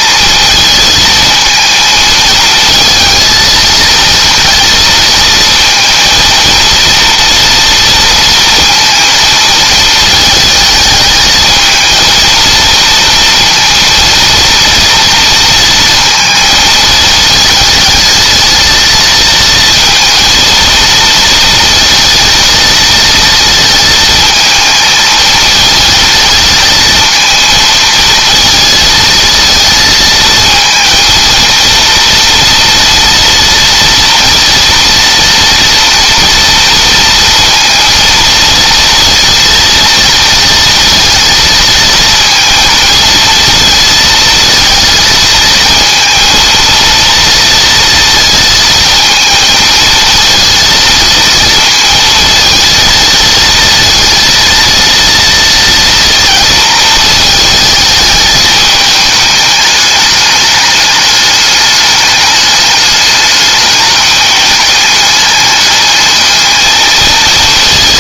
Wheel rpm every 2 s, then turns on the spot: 220, 220, 230, 230, 230, 220, 230, 230, 220, 230, 230, 230, 220, 220, 230, 220, 230, 230, 230, 230, 230, 230, 230, 230, 230, 230, 230, 230, 230, 210, 210, 210, 210, 220.
none